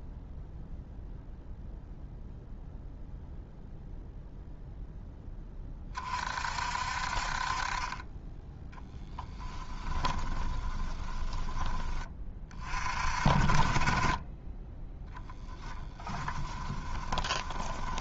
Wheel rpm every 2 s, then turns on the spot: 0, 0, 0, 50, 10, 20, 30, 10, 20.
10-12 14-18